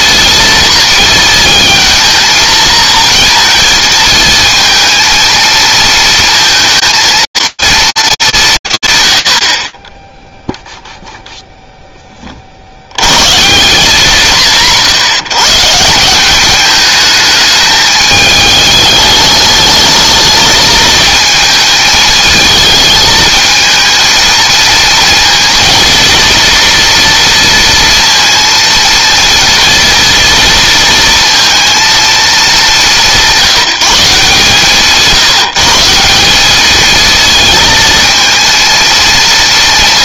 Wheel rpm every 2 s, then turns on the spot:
230, 230, 220, 230, 150, 0, 110, 150, 210, 210, 220, 220, 230, 230, 230, 230, 190, 160, 220, 230.
none